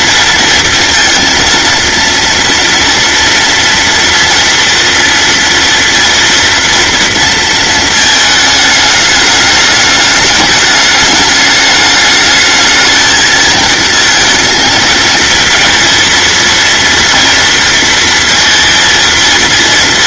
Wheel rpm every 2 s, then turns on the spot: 230, 230, 230, 230, 210, 210, 220, 220, 230, 230.
none